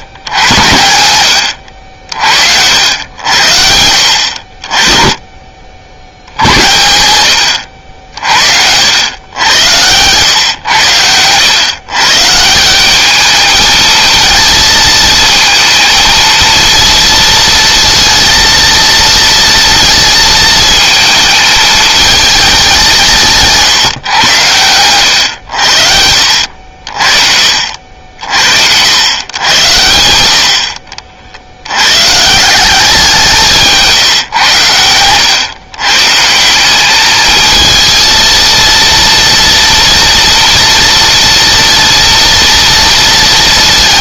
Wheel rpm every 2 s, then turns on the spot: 90, 80, 30, 100, 90, 100, 200, 220, 230, 230, 220, 180, 100, 50, 100, 60, 180, 100, 210, 230, 230, 230.
0-2